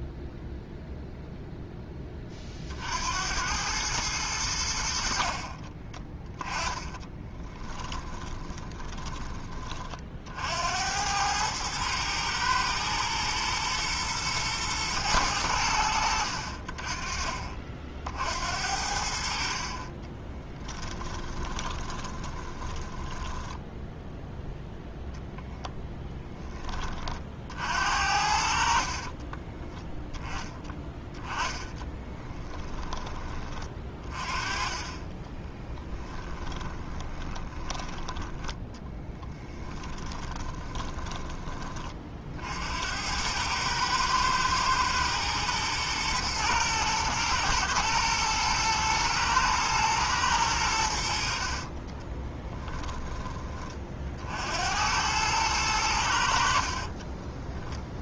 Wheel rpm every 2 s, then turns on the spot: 0, 60, 70, 20, 10, 80, 110, 110, 40, 60, 20, 20, 10, 30, 50, 10, 10, 30, 20, 10, 20, 80, 110, 120, 110, 90, 20, 80, 50.
6-10 20-24 28-30 36-42 52-54 56-58